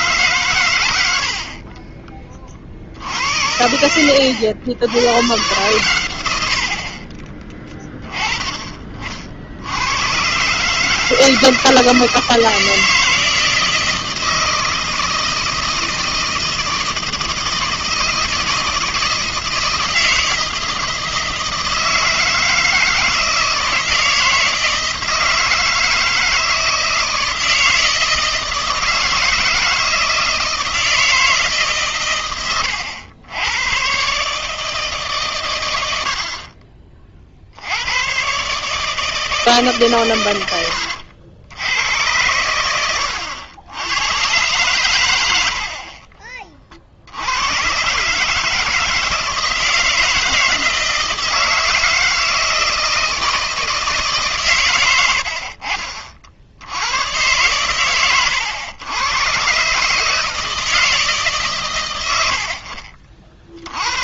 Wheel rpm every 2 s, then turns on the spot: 130, 40, 90, 70, 20, 140, 160, 160, 160, 160, 160, 160, 160, 160, 160, 160, 100, 150, 30, 140, 100, 90, 120, 30, 150, 160, 160, 120, 80, 100, 160, 70.
none